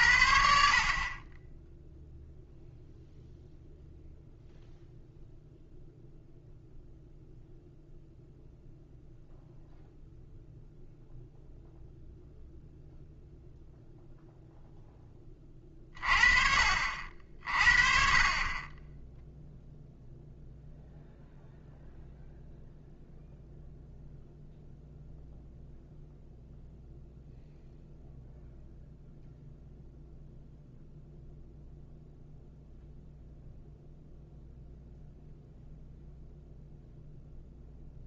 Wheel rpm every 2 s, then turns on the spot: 50, 0, 0, 0, 0, 0, 0, 0, 50, 10, 0, 0, 0, 0, 0, 0, 0, 0, 0.
none